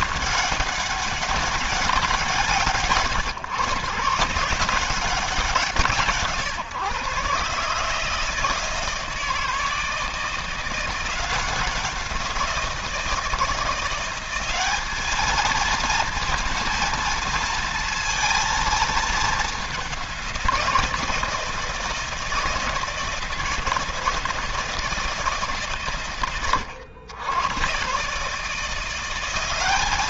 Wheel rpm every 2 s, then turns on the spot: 200, 140, 180, 140, 160, 170, 170, 200, 230, 220, 170, 160, 160, 110, 170.
none